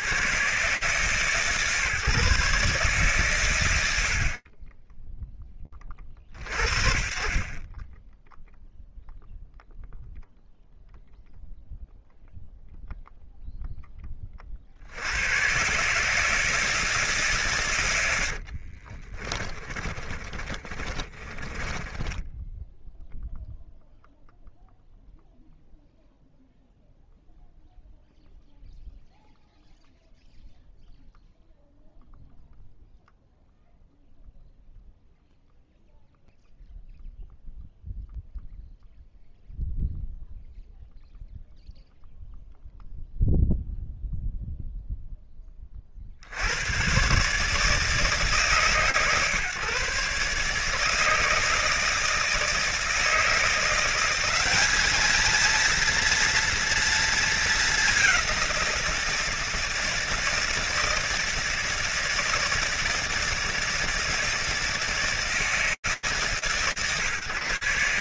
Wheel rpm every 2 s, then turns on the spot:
130, 140, 20, 50, 0, 0, 0, 90, 150, 40, 30, 0, 0, 0, 0, 0, 0, 0, 0, 0, 0, 0, 0, 110, 140, 150, 160, 210, 230, 170, 160, 160, 160, 160.
18-22